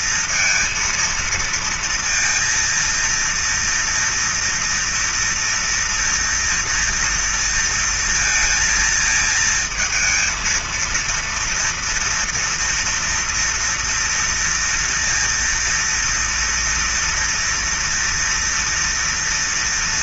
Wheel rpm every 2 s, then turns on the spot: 230, 230, 230, 230, 220, 230, 230, 230, 230, 230.
none